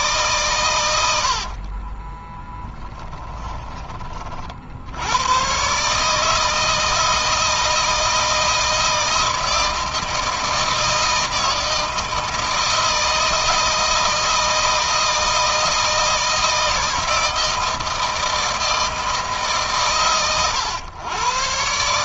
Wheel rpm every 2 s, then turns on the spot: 110, 10, 70, 160, 160, 160, 160, 160, 160, 160, 110.
2-4